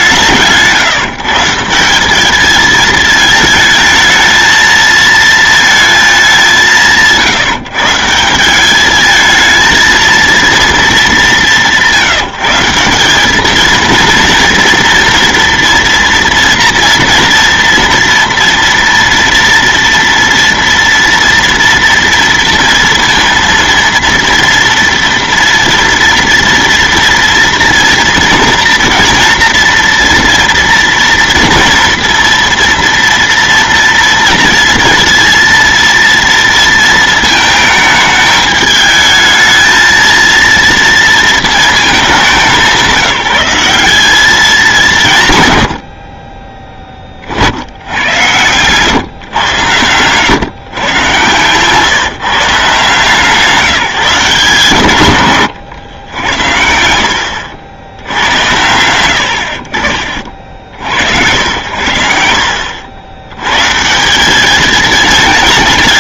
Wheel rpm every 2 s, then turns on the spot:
160, 220, 220, 170, 190, 230, 170, 230, 230, 240, 240, 230, 230, 230, 240, 230, 230, 230, 230, 220, 230, 190, 200, 30, 120, 130, 160, 160, 70, 80, 70, 80, 210.
none